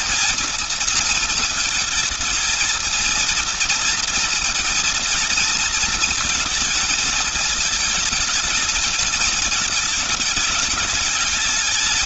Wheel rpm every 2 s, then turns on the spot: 230, 230, 230, 230, 220, 210.
none